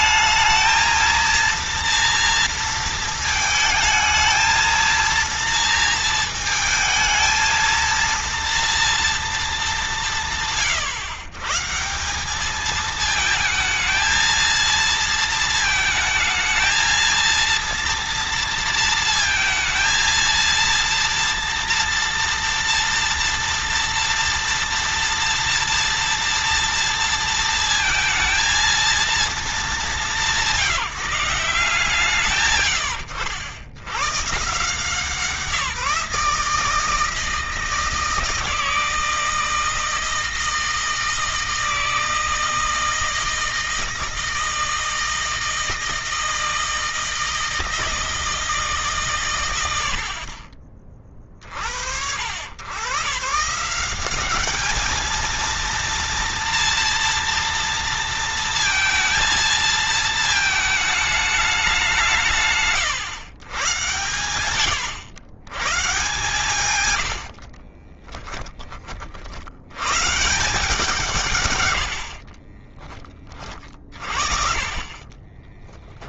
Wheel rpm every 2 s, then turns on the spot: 220, 230, 230, 220, 230, 120, 220, 220, 230, 230, 230, 240, 230, 230, 230, 180, 90, 160, 160, 160, 160, 160, 160, 160, 150, 30, 120, 220, 230, 230, 210, 130, 90, 130, 30, 160, 20, 30.
74-76